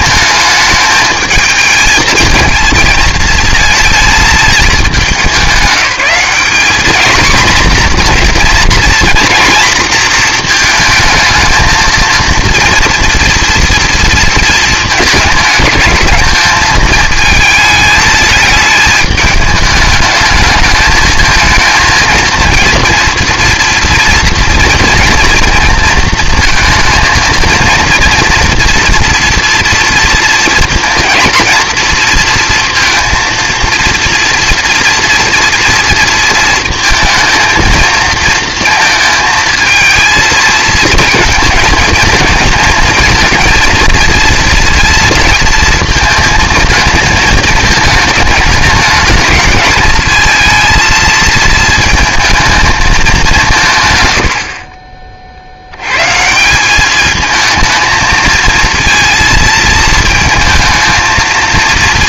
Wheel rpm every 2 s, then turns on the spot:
210, 230, 220, 210, 240, 230, 230, 220, 220, 210, 220, 230, 230, 230, 230, 220, 230, 230, 230, 220, 230, 220, 230, 220, 210, 230, 220, 50, 180, 230, 220.
none